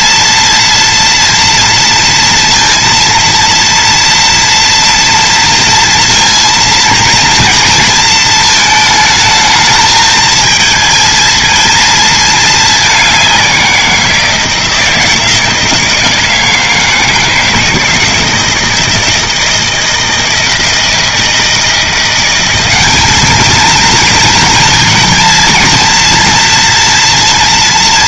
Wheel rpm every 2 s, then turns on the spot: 230, 230, 230, 230, 220, 220, 200, 160, 160, 160, 160, 200, 230, 240.
none